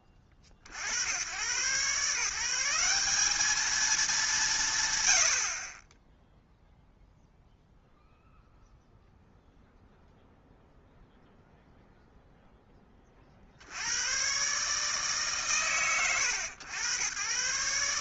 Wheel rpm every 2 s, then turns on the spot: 70, 180, 100, 0, 0, 0, 10, 130, 80.
none